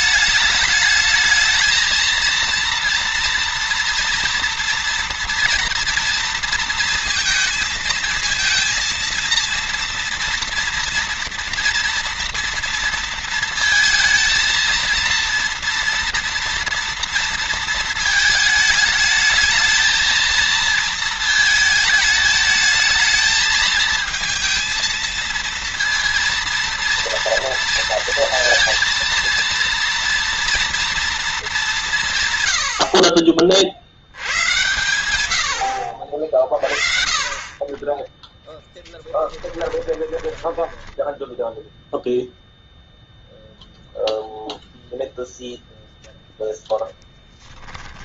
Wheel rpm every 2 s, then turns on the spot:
210, 230, 240, 230, 220, 230, 230, 220, 230, 220, 220, 220, 230, 230, 230, 230, 120, 90, 40, 10, 10, 0, 0, 10.
38-42